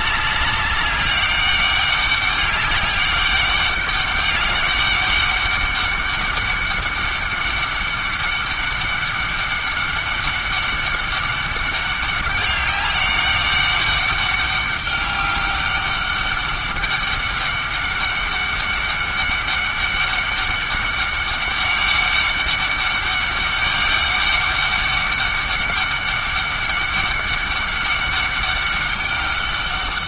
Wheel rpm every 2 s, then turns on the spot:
200, 200, 200, 200, 200, 200, 200, 200, 200, 200, 200, 200, 200, 200, 200.
none